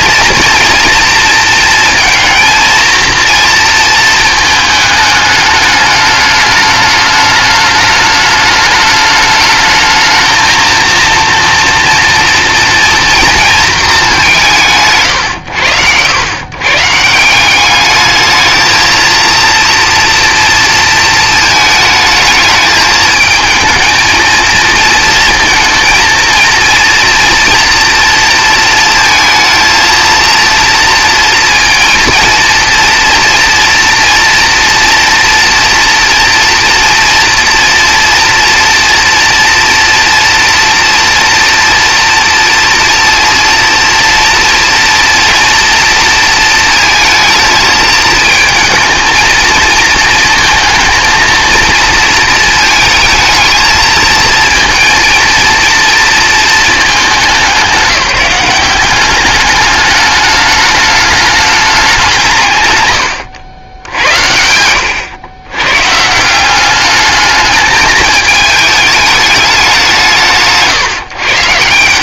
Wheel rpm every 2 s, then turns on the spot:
230, 230, 210, 210, 210, 230, 230, 130, 130, 220, 230, 220, 230, 230, 230, 230, 230, 230, 230, 230, 230, 230, 230, 220, 220, 230, 220, 230, 220, 190, 210, 120, 80, 190, 220, 130.
none